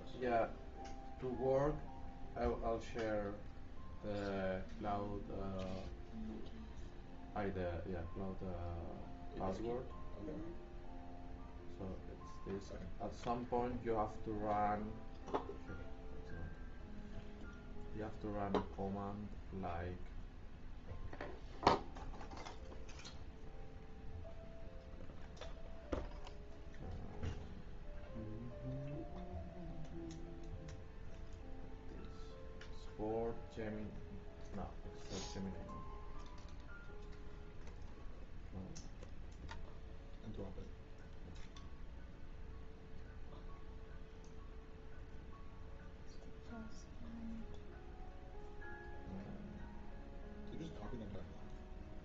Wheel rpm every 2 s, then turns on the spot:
0, 0, 0, 0, 0, 0, 0, 0, 0, 0, 0, 0, 0, 0, 0, 0, 0, 0, 0, 0, 0, 0, 0, 0, 0, 0.
none